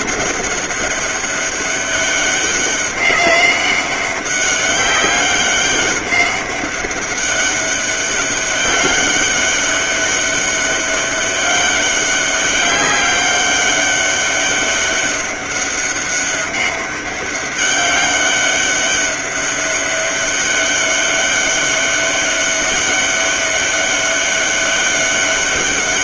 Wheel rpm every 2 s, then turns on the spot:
200, 200, 190, 200, 200, 200, 200, 200, 200, 200, 200, 200, 200.
none